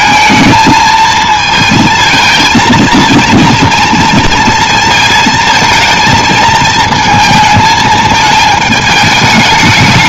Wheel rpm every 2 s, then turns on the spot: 220, 230, 230, 220, 220.
none